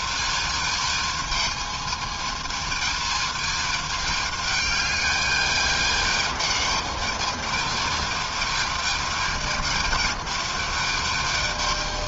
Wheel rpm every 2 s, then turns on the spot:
220, 220, 210, 210, 220, 220.
none